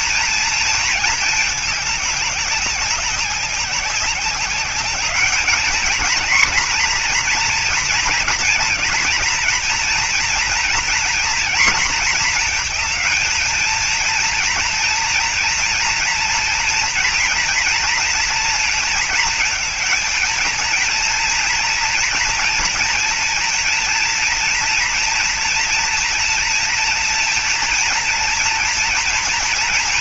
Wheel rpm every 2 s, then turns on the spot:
230, 200, 190, 230, 230, 240, 230, 240, 230, 230, 230, 230, 230, 230, 230.
none